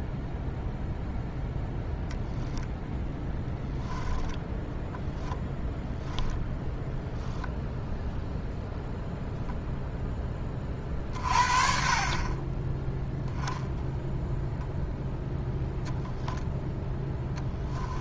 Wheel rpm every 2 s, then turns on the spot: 0, 10, 0, 0, 0, 30, 10, 0, 0.
none